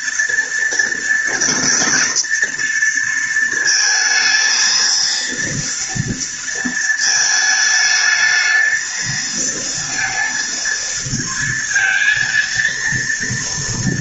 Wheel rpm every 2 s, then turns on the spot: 240, 230, 230, 230, 220, 230, 230.
none